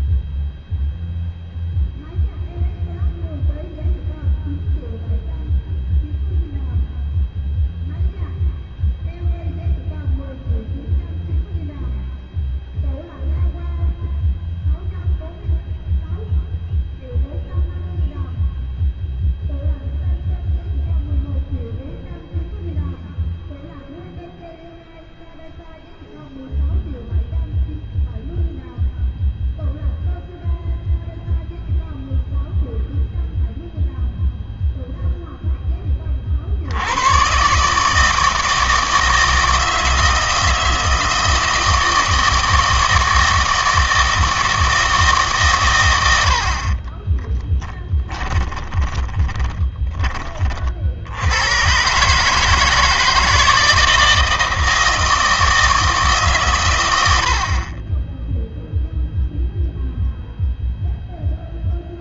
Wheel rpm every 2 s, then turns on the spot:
0, 0, 0, 0, 0, 0, 0, 0, 0, 0, 0, 0, 0, 0, 0, 0, 0, 0, 80, 160, 160, 160, 160, 50, 20, 60, 160, 160, 120, 0, 0.
48-50